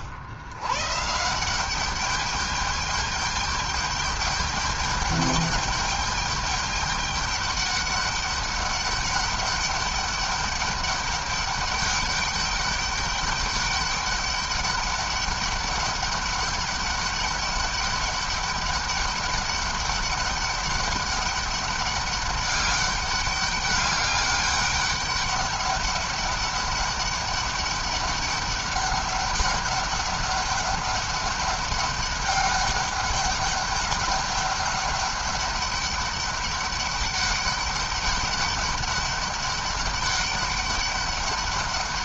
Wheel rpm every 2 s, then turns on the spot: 100, 200, 210, 210, 200, 200, 200, 200, 200, 200, 200, 200, 200, 200, 200, 200, 200, 200, 200, 200, 200.
none